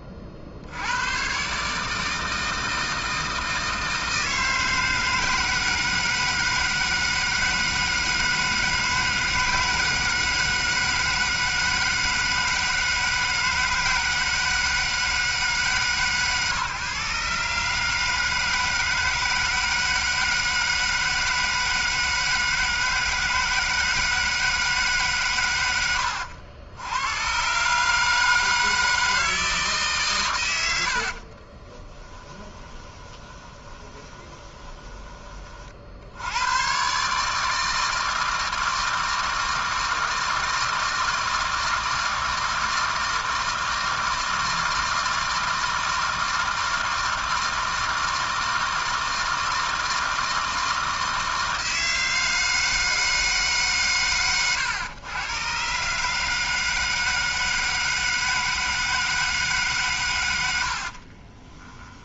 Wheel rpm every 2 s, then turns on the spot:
80, 160, 160, 160, 160, 160, 160, 160, 130, 160, 160, 160, 150, 100, 160, 90, 20, 20, 120, 160, 160, 160, 160, 160, 160, 160, 160, 110, 160, 160, 70.
32-36 60-62